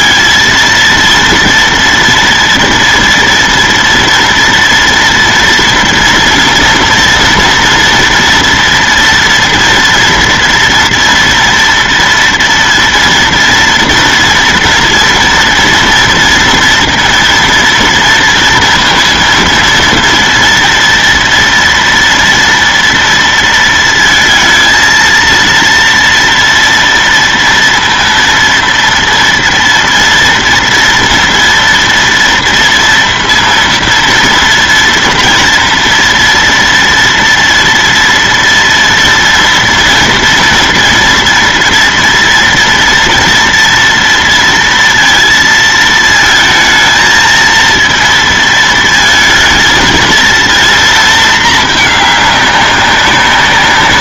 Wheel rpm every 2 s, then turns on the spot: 230, 230, 230, 230, 240, 240, 230, 230, 230, 230, 240, 230, 230, 230, 230, 230, 230, 230, 230, 230, 230, 230, 230, 230, 230, 230, 200.
none